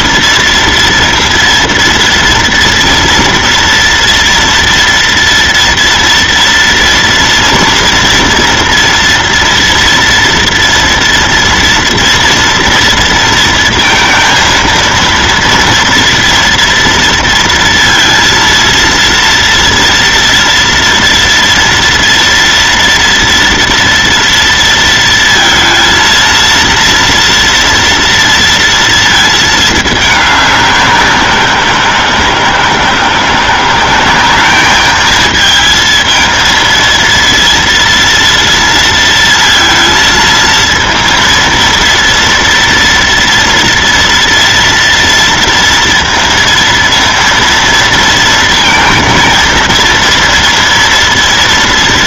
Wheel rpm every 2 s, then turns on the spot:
240, 230, 230, 230, 230, 230, 230, 230, 230, 230, 230, 230, 230, 230, 230, 200, 170, 200, 230, 230, 230, 230, 230, 230, 230, 230.
none